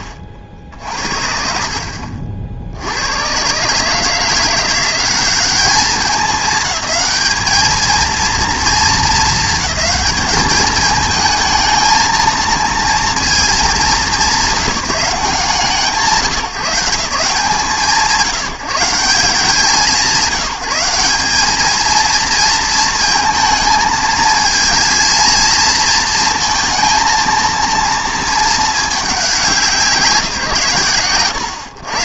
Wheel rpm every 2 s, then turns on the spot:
50, 70, 170, 200, 230, 210, 230, 200, 150, 150, 180, 220, 230, 230, 220, 130.
none